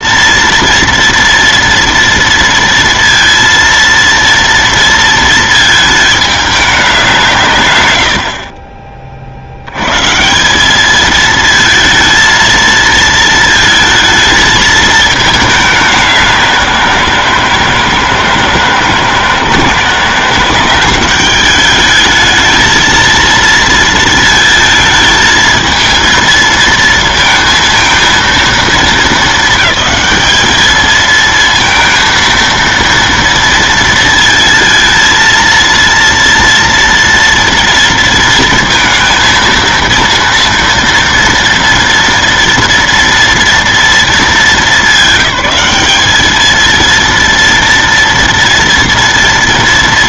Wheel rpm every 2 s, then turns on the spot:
230, 230, 230, 210, 70, 150, 230, 220, 190, 160, 160, 220, 230, 230, 230, 210, 230, 230, 230, 230, 230, 230, 230, 210, 230.
8-10